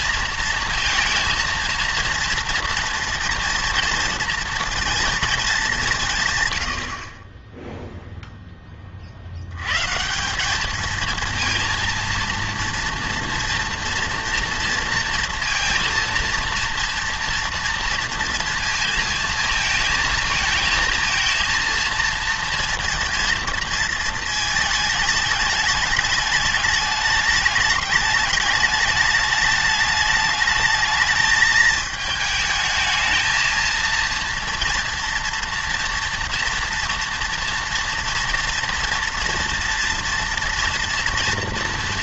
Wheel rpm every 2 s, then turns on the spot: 230, 230, 230, 90, 10, 210, 230, 230, 230, 230, 220, 230, 220, 210, 210, 220, 220, 230, 230, 240, 230.
none